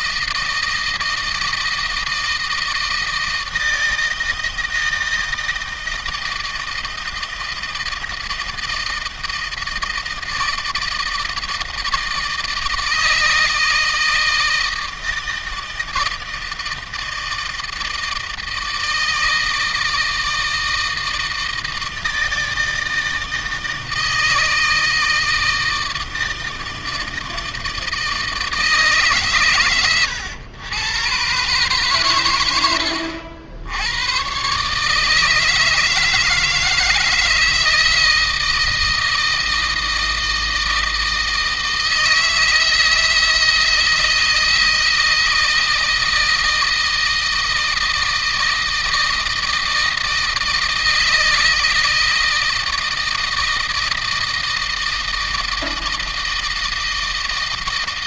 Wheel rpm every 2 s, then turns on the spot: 160, 160, 160, 160, 160, 160, 160, 160, 160, 160, 160, 160, 160, 160, 150, 120, 100, 130, 160, 160, 160, 160, 160, 160, 160, 160, 160, 160, 160.
none